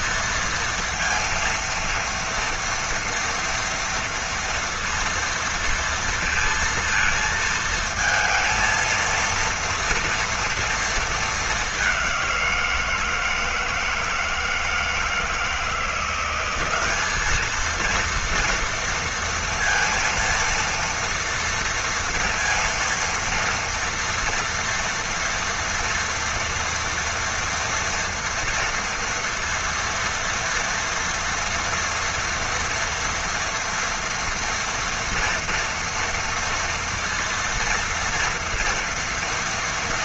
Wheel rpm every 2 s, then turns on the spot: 230, 230, 230, 230, 230, 230, 180, 160, 190, 230, 230, 230, 230, 230, 230, 230, 230, 230, 230, 230.
none